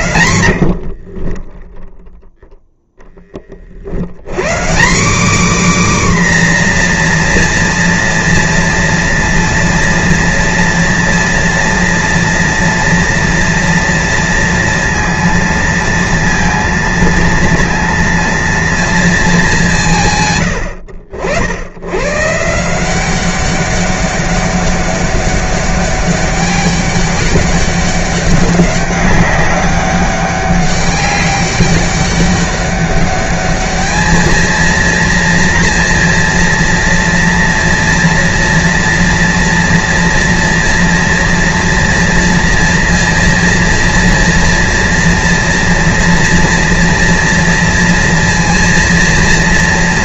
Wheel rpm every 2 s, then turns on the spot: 70, 0, 150, 260, 230, 230, 230, 230, 230, 230, 120, 150, 200, 200, 200, 200, 200, 220, 230, 230, 230, 230, 230, 230, 230.
0-2